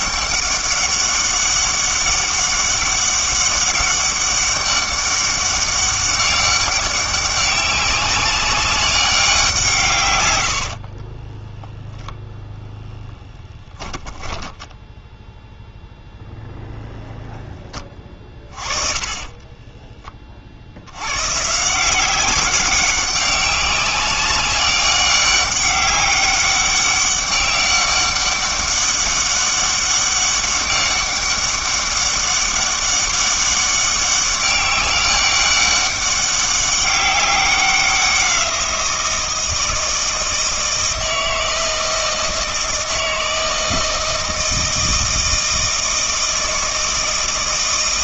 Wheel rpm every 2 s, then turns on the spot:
200, 200, 200, 190, 200, 60, 10, 10, 0, 30, 70, 190, 200, 200, 200, 200, 200, 190, 200, 170, 160, 160, 160, 160.
10-12 14-16 18-20